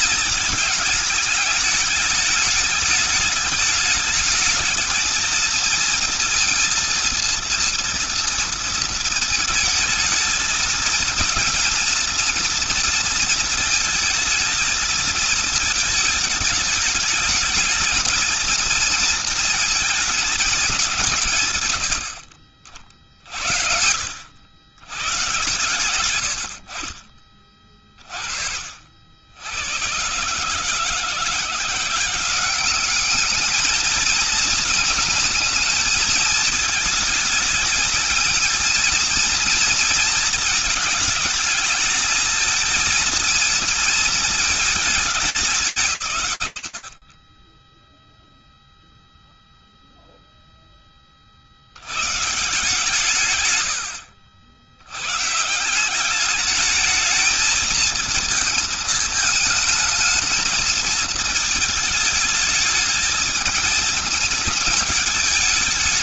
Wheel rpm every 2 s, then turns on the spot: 220, 210, 220, 220, 230, 230, 230, 230, 220, 230, 220, 70, 70, 80, 50, 140, 190, 220, 220, 220, 220, 220, 230, 130, 0, 10, 150, 80, 210, 220, 220, 210, 220.
none